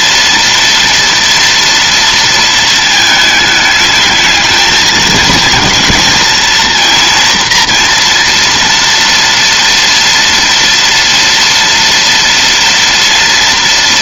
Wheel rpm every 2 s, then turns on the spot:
230, 230, 220, 230, 240, 230, 230.
none